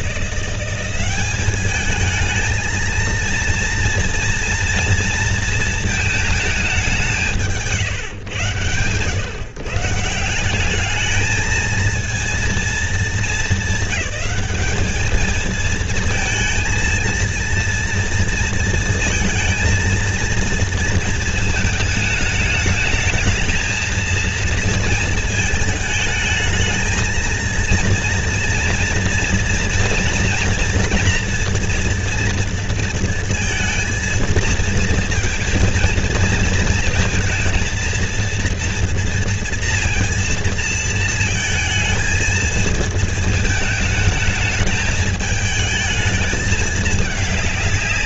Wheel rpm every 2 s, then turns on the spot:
180, 220, 230, 200, 110, 190, 230, 200, 230, 230, 230, 210, 230, 220, 230, 230, 230, 230, 230, 230, 230, 220, 220, 220.
none